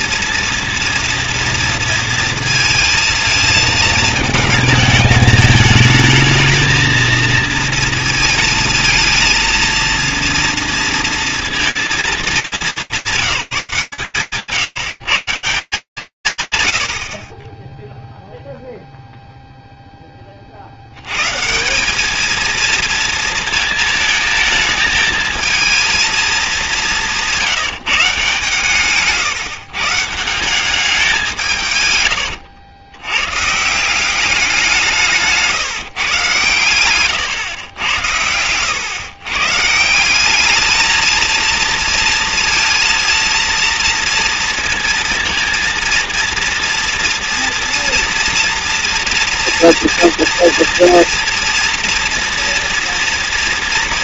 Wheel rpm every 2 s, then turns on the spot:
230, 230, 220, 220, 230, 230, 200, 150, 160, 0, 70, 230, 220, 190, 150, 190, 100, 180, 110, 120, 220, 230, 230, 240, 240, 230, 230.
28-30 36-38